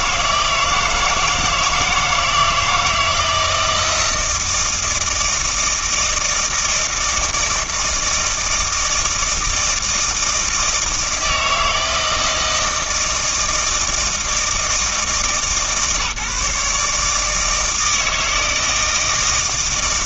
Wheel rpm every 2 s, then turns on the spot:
160, 160, 160, 160, 160, 160, 160, 160, 150, 160.
none